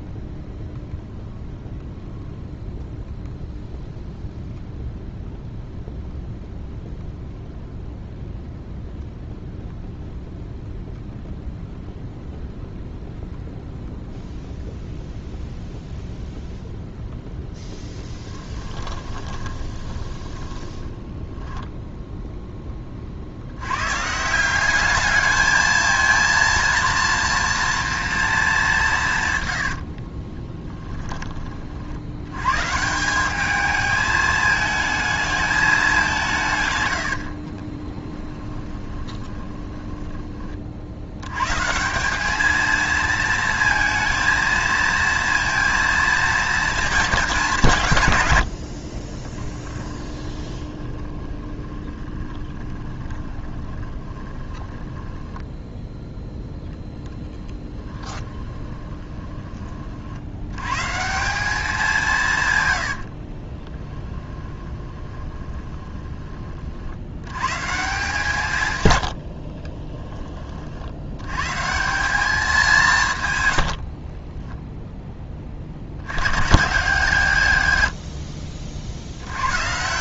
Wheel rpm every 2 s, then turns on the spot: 0, 0, 0, 0, 0, 0, 0, 0, 0, 20, 10, 20, 190, 230, 180, 10, 160, 220, 120, 20, 60, 220, 230, 220, 60, 20, 20, 20, 10, 20, 130, 100, 20, 60, 110, 60, 180, 10, 130, 50.
18-22 30-32 38-40 48-56 58-60 62-66 68-70